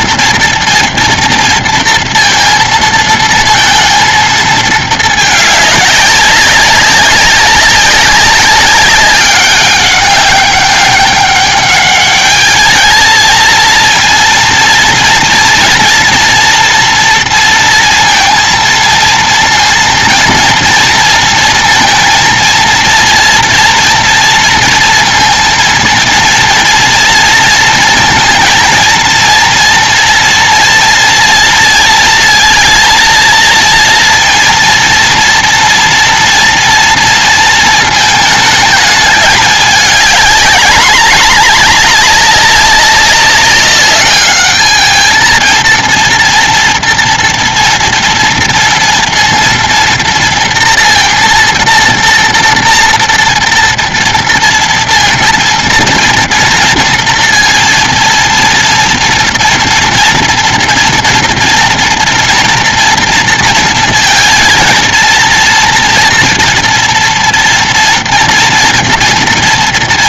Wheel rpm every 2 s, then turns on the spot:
230, 230, 220, 200, 200, 200, 210, 230, 230, 230, 230, 230, 230, 230, 230, 240, 230, 230, 230, 220, 210, 200, 210, 230, 230, 230, 230, 230, 230, 230, 230, 230, 230, 230, 240.
none